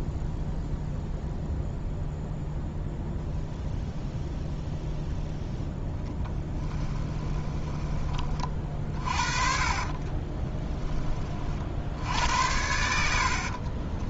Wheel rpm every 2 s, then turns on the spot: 0, 0, 0, 10, 40, 20, 80.
6-10